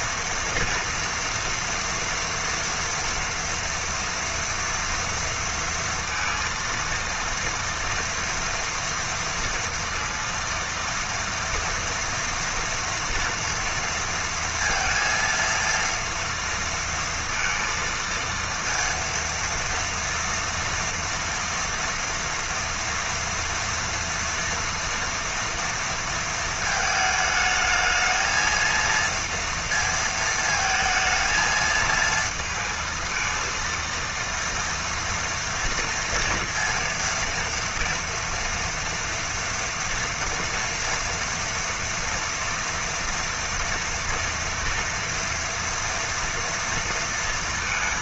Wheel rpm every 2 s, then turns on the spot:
230, 230, 230, 230, 230, 230, 230, 230, 230, 230, 230, 230, 230, 230, 230, 220, 230, 230, 230, 230, 230, 240, 230, 230.
none